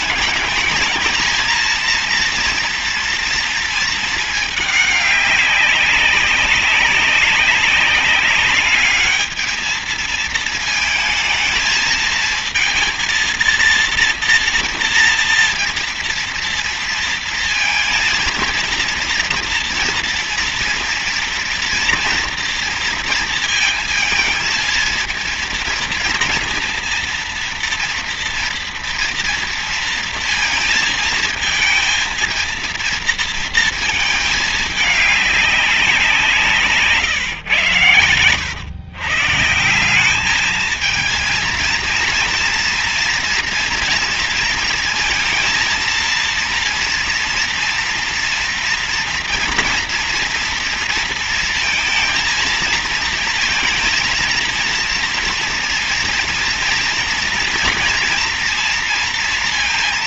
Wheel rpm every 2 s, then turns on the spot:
220, 230, 200, 190, 210, 220, 230, 230, 230, 230, 230, 230, 230, 230, 230, 220, 230, 200, 140, 120, 220, 240, 230, 230, 230, 230, 230, 230, 240, 230.
none